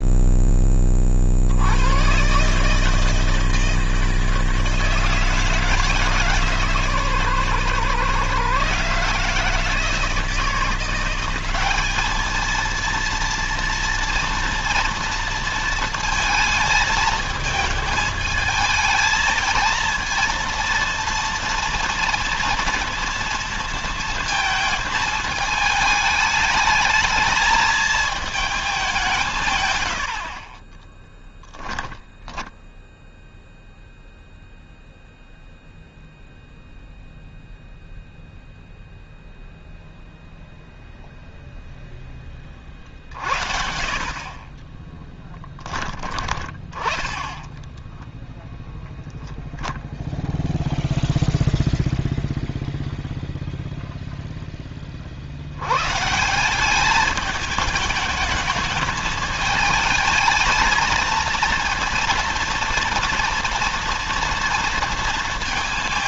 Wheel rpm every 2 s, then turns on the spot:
30, 150, 160, 140, 140, 180, 230, 230, 220, 220, 230, 230, 220, 220, 190, 20, 0, 0, 0, 0, 0, 40, 10, 10, 0, 0, 0, 40, 210, 220, 220, 230, 230.
30-32 44-46